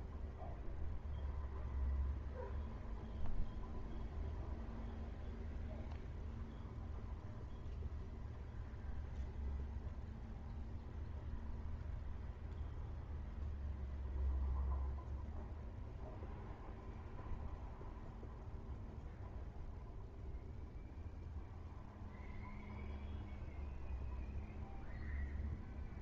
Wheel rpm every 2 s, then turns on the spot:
0, 0, 0, 0, 0, 0, 0, 0, 0, 0, 0, 0, 0.
none